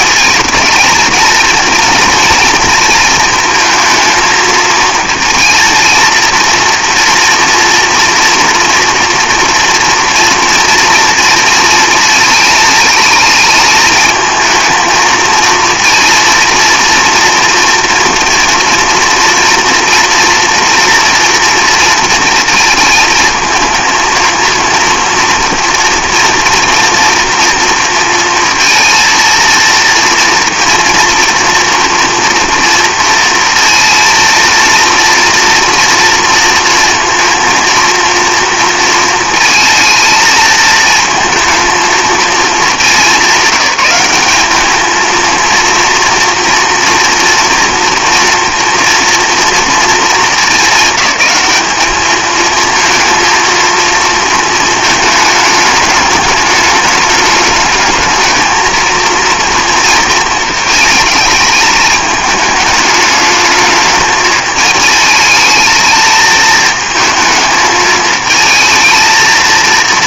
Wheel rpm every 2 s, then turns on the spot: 220, 230, 220, 230, 240, 230, 220, 220, 230, 230, 240, 230, 230, 230, 230, 240, 230, 230, 230, 230, 220, 220, 210, 230, 230, 210, 220, 220, 210, 220, 220, 210, 210, 220, 220.
none